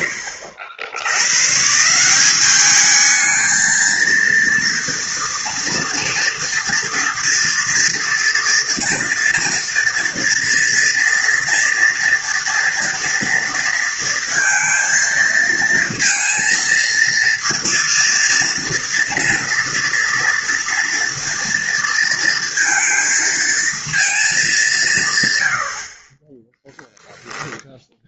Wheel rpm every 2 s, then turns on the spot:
80, 200, 230, 240, 230, 230, 230, 230, 230, 230, 230, 230, 190, 10.
26-28